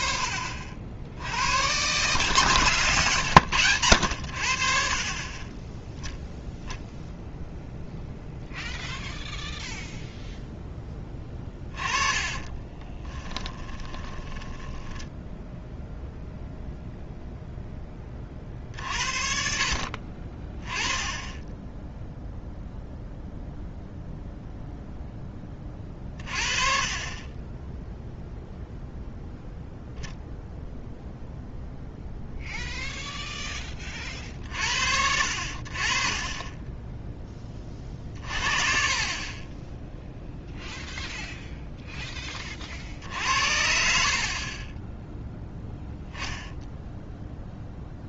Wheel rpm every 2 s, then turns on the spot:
70, 130, 60, 0, 0, 0, 20, 10, 0, 70, 30, 0, 0, 40, 0, 0, 0, 50, 10, 40, 0, 40, 20, 0.
12-16 44-46